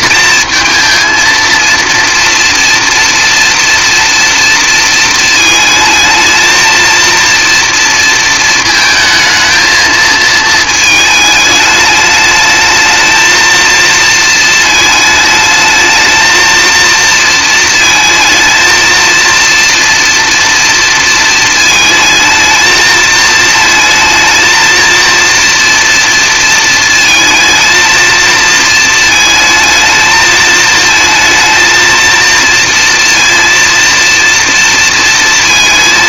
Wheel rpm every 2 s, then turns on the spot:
220, 230, 230, 230, 220, 220, 220, 220, 230, 230, 230, 220, 230, 230, 220, 220, 230, 230.
none